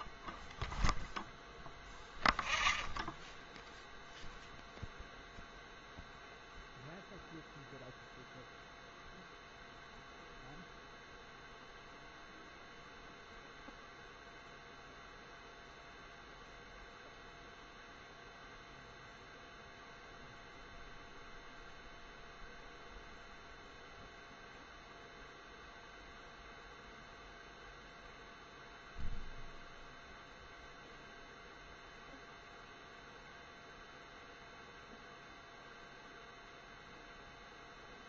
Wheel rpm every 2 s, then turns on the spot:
0, 0, 0, 0, 0, 0, 0, 0, 0, 0, 0, 0, 0, 0, 0, 0, 0, 0, 0.
none